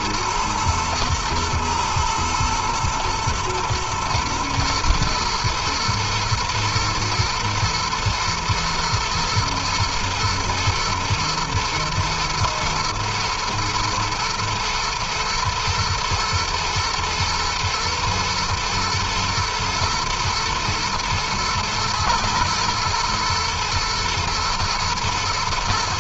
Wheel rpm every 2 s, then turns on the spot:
120, 110, 110, 120, 110, 110, 120, 120, 120, 120, 110, 120, 110.
none